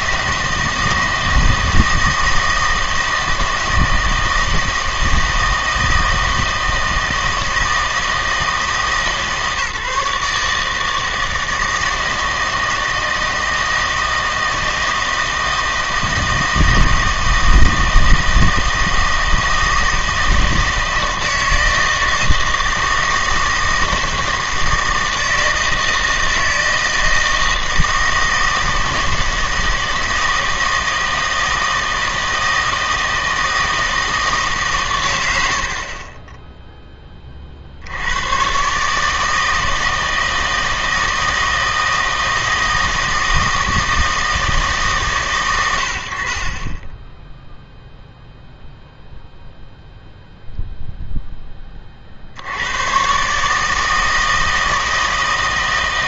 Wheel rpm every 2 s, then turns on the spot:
160, 160, 160, 160, 150, 160, 160, 160, 160, 160, 160, 160, 160, 160, 160, 160, 160, 130, 10, 140, 160, 160, 140, 10, 0, 0, 100, 160.
none